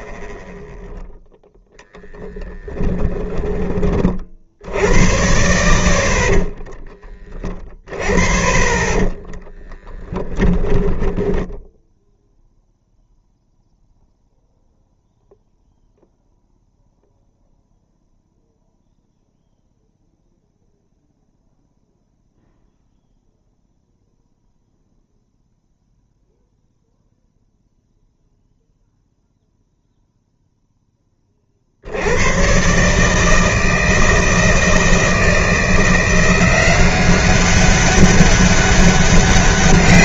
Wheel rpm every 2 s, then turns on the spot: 0, 10, 60, 40, 30, 10, 0, 0, 0, 0, 0, 0, 0, 0, 0, 0, 130, 160, 180, 200.
2-4 6-8 10-12